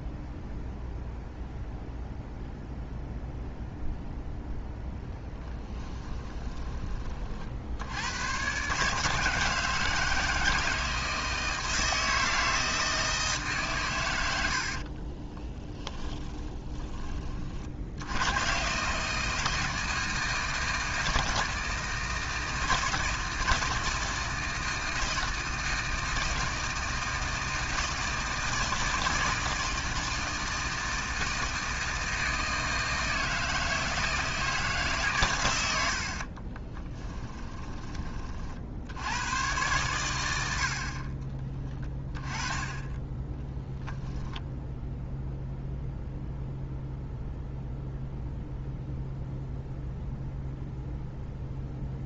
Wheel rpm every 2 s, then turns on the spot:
0, 0, 0, 30, 140, 160, 160, 50, 20, 140, 160, 160, 160, 160, 160, 160, 160, 150, 20, 80, 50, 20, 0, 0, 0, 0.
14-16 36-38